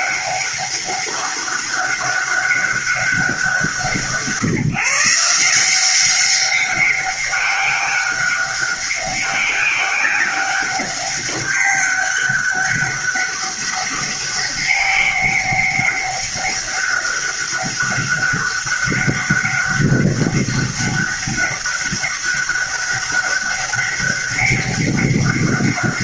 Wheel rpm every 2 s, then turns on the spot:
200, 200, 160, 190, 200, 200, 200, 200, 200, 200, 200, 200, 200.
none